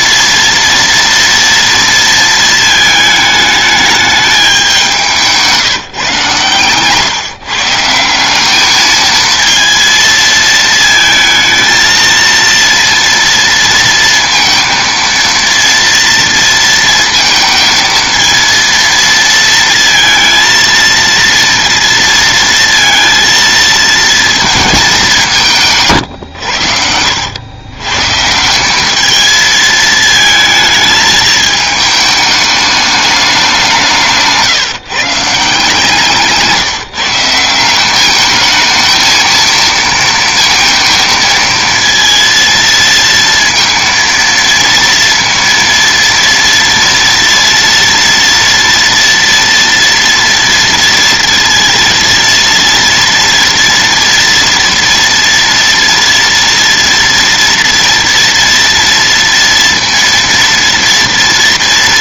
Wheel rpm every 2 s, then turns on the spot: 230, 220, 190, 140, 210, 220, 230, 230, 230, 230, 230, 230, 210, 80, 180, 220, 210, 150, 160, 220, 230, 230, 230, 230, 230, 230, 230, 230, 230, 230, 230.
6-8